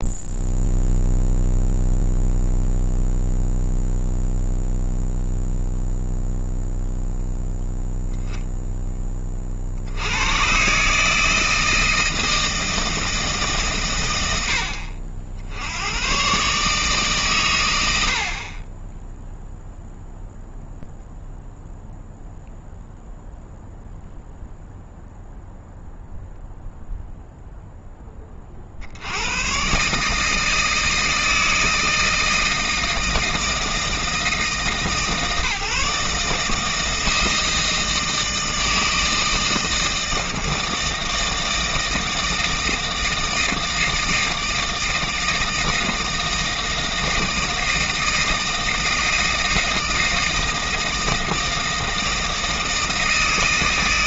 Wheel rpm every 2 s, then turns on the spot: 0, 0, 0, 0, 10, 120, 160, 90, 130, 40, 0, 0, 0, 0, 40, 160, 160, 160, 160, 160, 160, 160, 160, 160, 160, 160, 160.
none